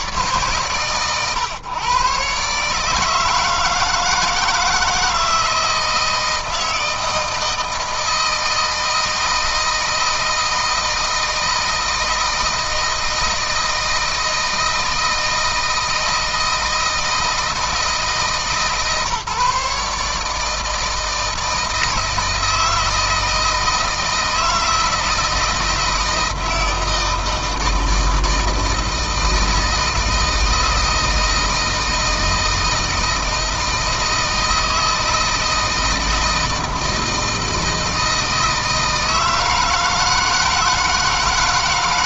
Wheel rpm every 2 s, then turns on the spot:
130, 150, 160, 160, 160, 160, 160, 160, 160, 150, 160, 160, 160, 160, 160, 160, 160, 160, 160, 160, 160.
none